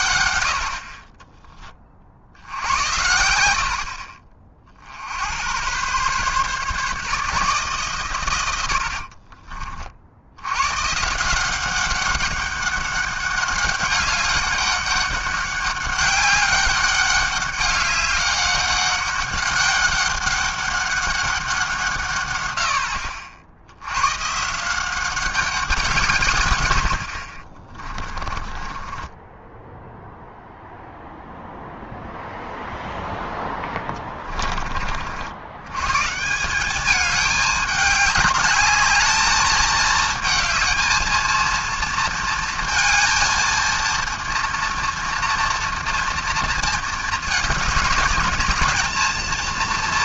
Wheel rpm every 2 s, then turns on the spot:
70, 80, 50, 140, 100, 110, 200, 200, 200, 200, 200, 100, 150, 110, 20, 0, 0, 30, 180, 210, 220, 230, 230, 230, 210.
28-30